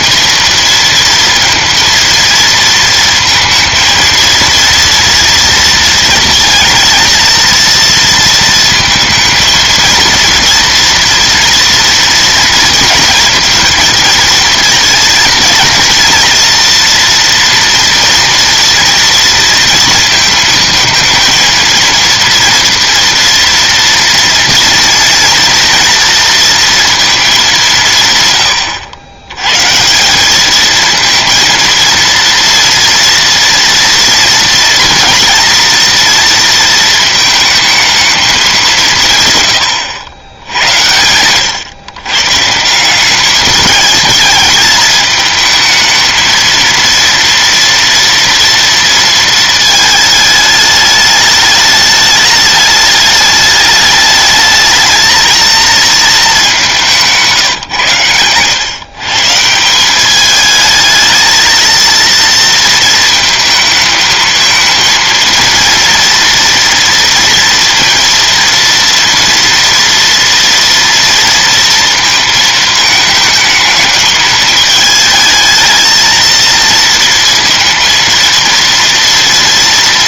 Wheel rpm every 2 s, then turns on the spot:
230, 230, 230, 230, 230, 230, 230, 230, 240, 230, 220, 230, 230, 230, 100, 220, 230, 240, 230, 180, 90, 170, 210, 230, 230, 210, 210, 220, 190, 130, 220, 220, 230, 230, 230, 230, 220, 220, 230, 230.
none